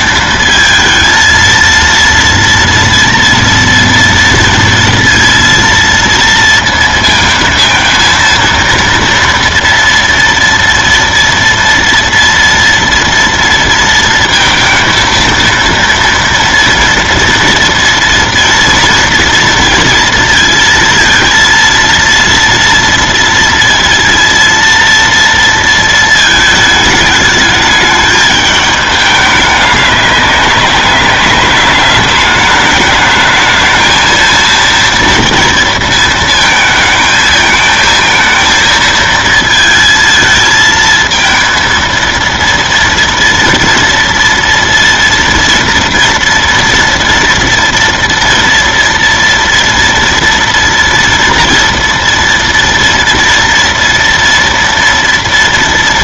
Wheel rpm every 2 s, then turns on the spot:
230, 230, 230, 230, 230, 230, 230, 230, 230, 230, 230, 230, 230, 220, 210, 200, 210, 230, 230, 220, 220, 230, 230, 230, 230, 240, 230, 230.
none